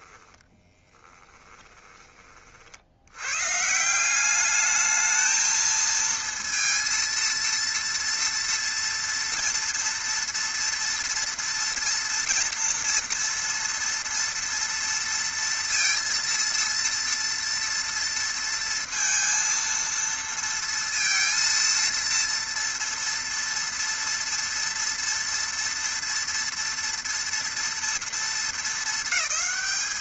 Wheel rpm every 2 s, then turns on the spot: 10, 50, 210, 230, 230, 230, 230, 230, 230, 230, 230, 230, 230, 230, 220.
0-2